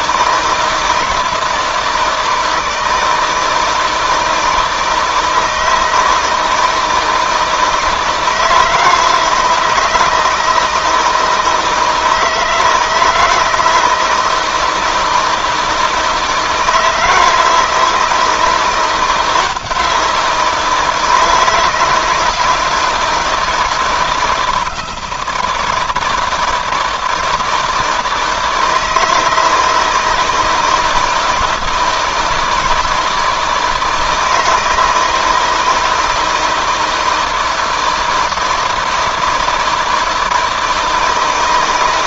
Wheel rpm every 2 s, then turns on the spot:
160, 160, 160, 160, 160, 160, 160, 160, 170, 170, 160, 160, 160, 160, 160, 160, 160, 160, 160, 160, 160.
none